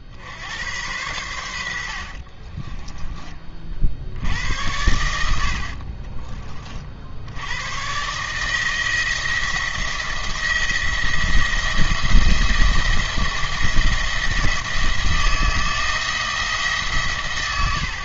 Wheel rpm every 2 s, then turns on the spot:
90, 20, 80, 40, 160, 170, 170, 160, 150.
2-4